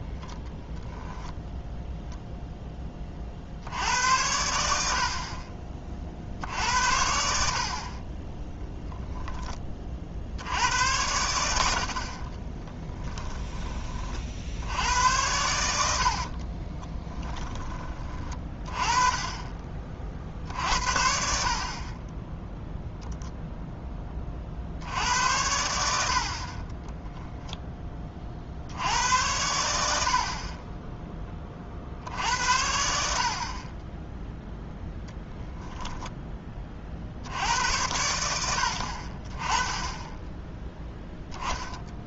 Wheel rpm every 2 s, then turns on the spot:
0, 10, 70, 60, 0, 80, 10, 80, 30, 20, 60, 0, 60, 30, 70, 20, 70, 0, 20, 70, 0.
12-14 16-18